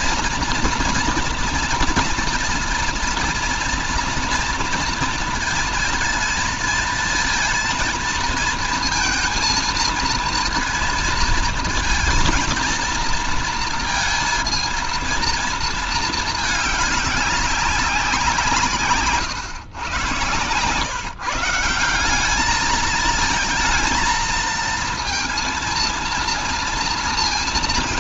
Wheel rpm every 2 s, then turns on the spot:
240, 230, 230, 230, 230, 230, 230, 230, 210, 160, 120, 210, 230, 230.
none